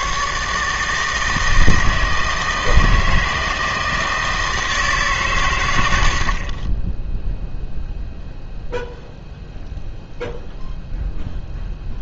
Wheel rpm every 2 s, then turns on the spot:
150, 160, 160, 20, 0, 0.
none